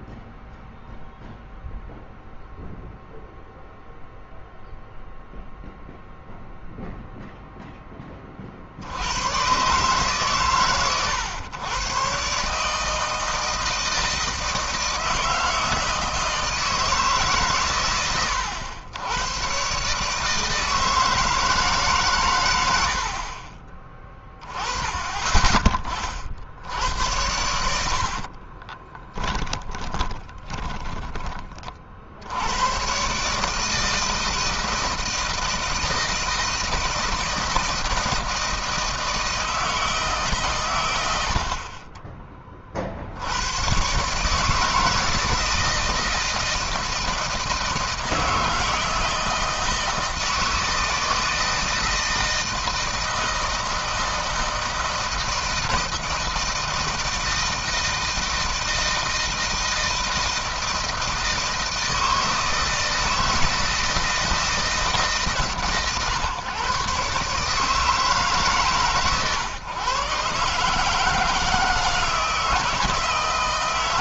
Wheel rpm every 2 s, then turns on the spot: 0, 0, 0, 0, 80, 110, 150, 160, 150, 100, 160, 80, 20, 70, 20, 20, 120, 160, 160, 160, 100, 60, 160, 160, 160, 160, 160, 160, 160, 160, 160, 160, 150, 140, 130, 150, 160.
28-32